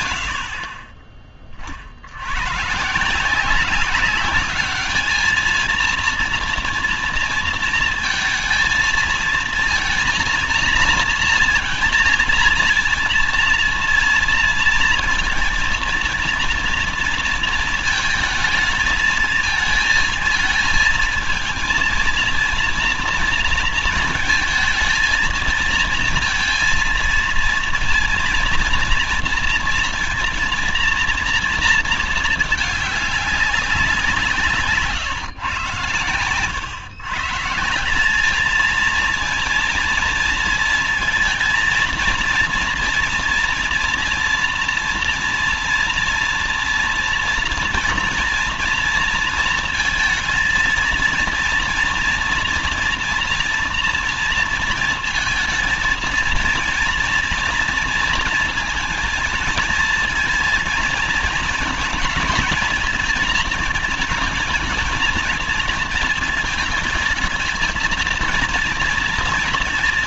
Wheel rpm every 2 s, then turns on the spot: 30, 130, 200, 230, 230, 230, 230, 230, 230, 220, 230, 230, 230, 230, 230, 230, 210, 150, 120, 220, 230, 230, 230, 230, 230, 230, 230, 220, 230, 230, 230, 230, 220, 220, 230.
none